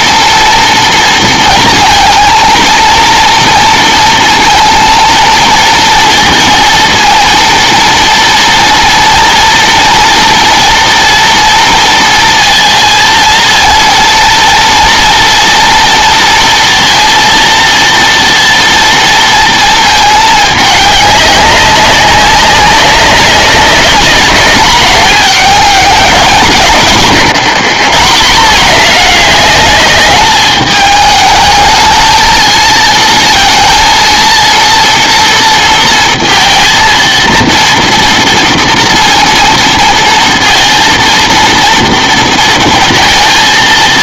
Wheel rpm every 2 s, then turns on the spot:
230, 230, 230, 230, 230, 230, 230, 230, 230, 230, 210, 200, 200, 130, 190, 210, 220, 230, 230, 230, 230, 230.
none